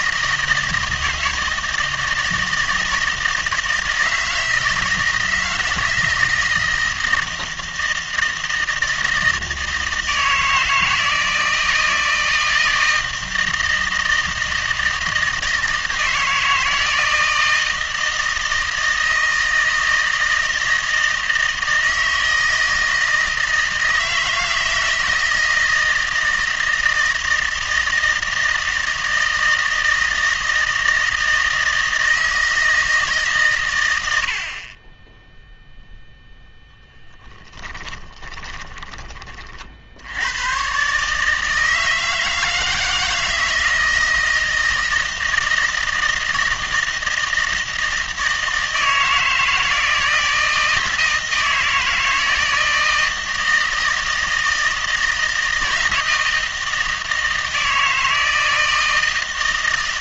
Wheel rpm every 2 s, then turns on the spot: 160, 160, 160, 160, 160, 160, 160, 160, 160, 160, 160, 160, 160, 160, 160, 160, 160, 40, 0, 20, 130, 160, 160, 160, 160, 160, 160, 160, 160, 160.
38-40